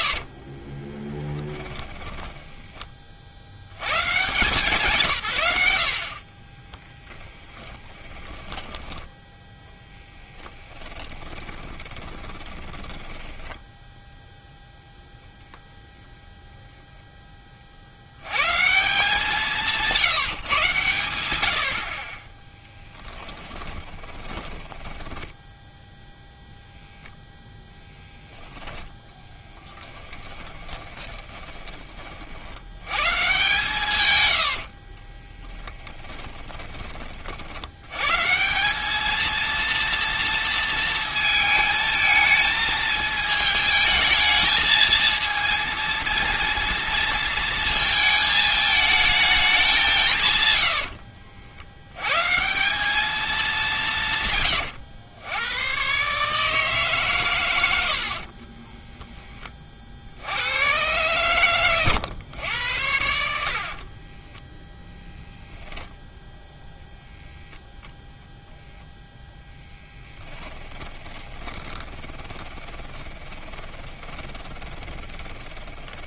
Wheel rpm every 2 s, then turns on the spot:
20, 30, 150, 20, 20, 30, 20, 0, 0, 160, 120, 10, 10, 0, 10, 20, 100, 40, 20, 200, 230, 220, 220, 230, 220, 80, 190, 110, 140, 10, 120, 90, 10, 0, 0, 20, 10, 10.
0-2 6-14 22-26 30-32 34-36 50-52 58-60 70-76